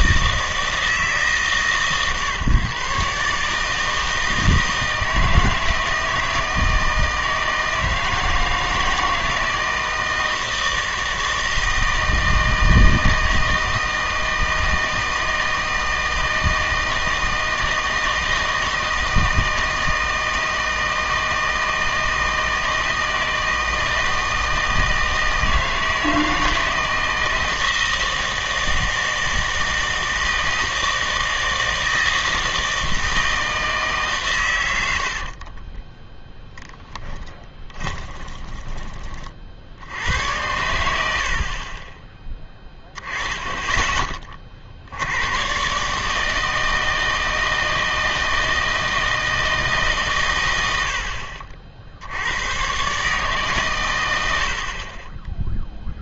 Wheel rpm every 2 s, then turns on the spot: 160, 130, 160, 160, 160, 160, 160, 160, 160, 160, 160, 160, 160, 160, 160, 160, 160, 100, 10, 20, 90, 10, 60, 160, 160, 60, 120, 50.
none